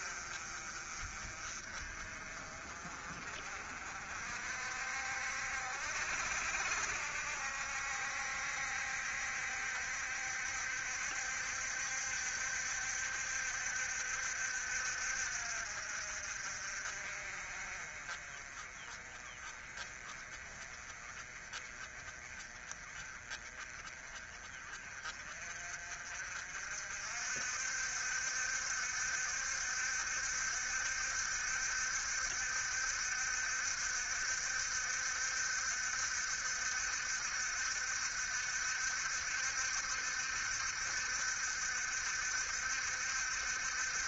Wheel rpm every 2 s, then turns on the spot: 40, 40, 60, 60, 70, 70, 70, 60, 50, 30, 30, 30, 40, 60, 70, 70, 70, 70, 70, 70, 70, 70.
none